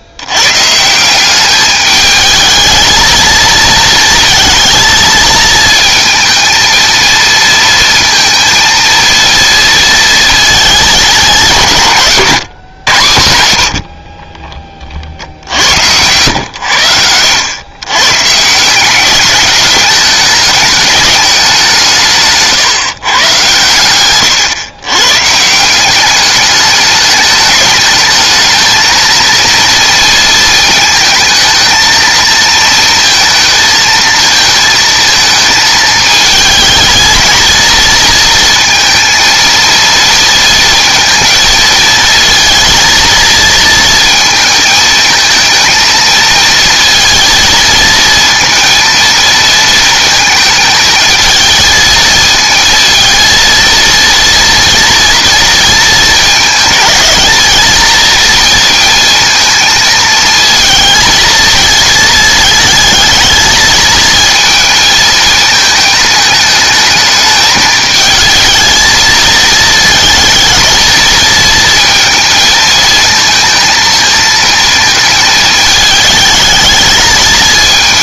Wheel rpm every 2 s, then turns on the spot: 130, 220, 220, 220, 230, 200, 130, 30, 100, 170, 210, 140, 120, 210, 220, 230, 230, 230, 220, 230, 230, 220, 220, 230, 230, 220, 230, 240, 220, 230, 220, 220, 220, 220, 220, 220, 230, 220, 220.
none